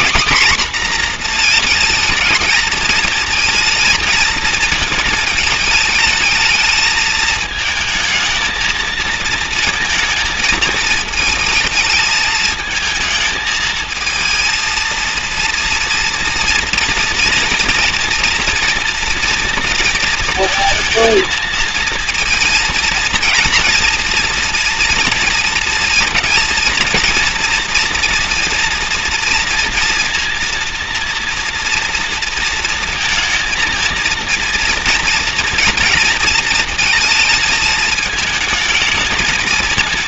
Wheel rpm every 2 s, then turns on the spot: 250, 220, 220, 220, 220, 220, 220, 230, 230, 230, 220, 230, 230, 230, 230, 230, 230, 230, 230, 220.
none